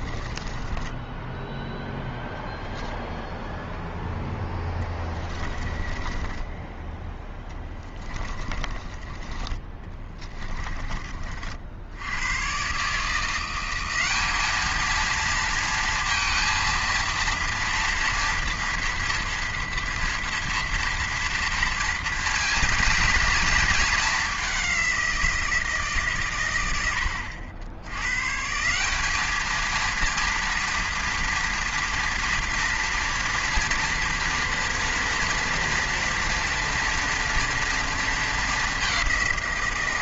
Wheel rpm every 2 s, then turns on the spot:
20, 0, 20, 20, 20, 20, 130, 220, 230, 230, 230, 230, 200, 100, 170, 230, 230, 230, 240, 200.
0-2 4-10